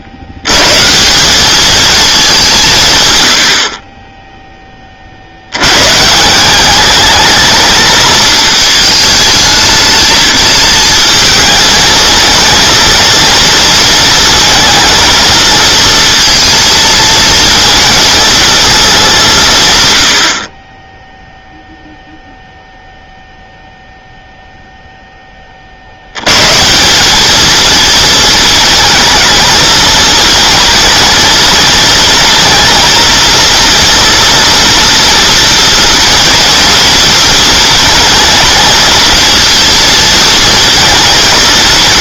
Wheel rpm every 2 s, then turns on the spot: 140, 120, 30, 200, 220, 220, 220, 230, 230, 210, 20, 0, 0, 170, 230, 230, 230, 230, 240, 220, 220.
none